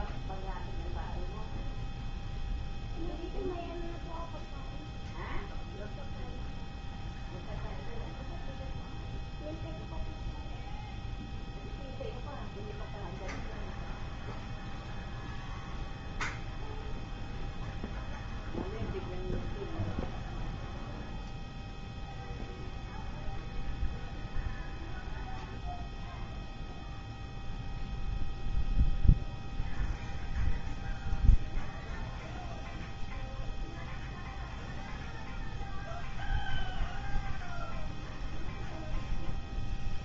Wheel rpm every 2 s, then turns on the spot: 0, 0, 0, 0, 0, 0, 0, 0, 0, 0, 0, 0, 0, 0, 0, 0, 0, 0, 0, 0.
none